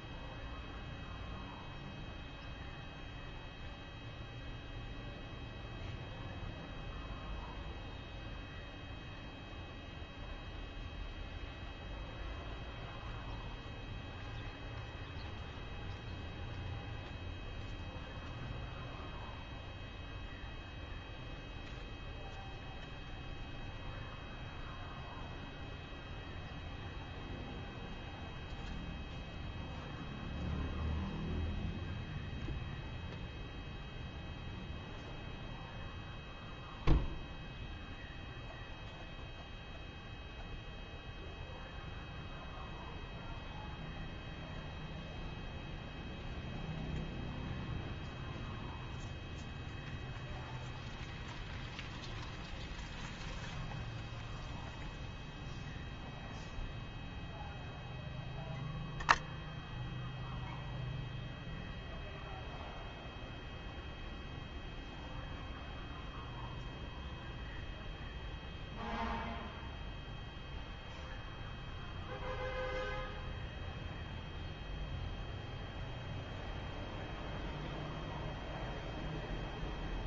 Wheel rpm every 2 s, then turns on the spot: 0, 0, 0, 0, 0, 0, 0, 0, 0, 0, 0, 0, 0, 0, 0, 0, 0, 0, 0, 0, 0, 0, 0, 0, 0, 0, 0, 0, 0, 20, 10, 0, 0, 0, 0, 0, 0, 0, 0, 0.
none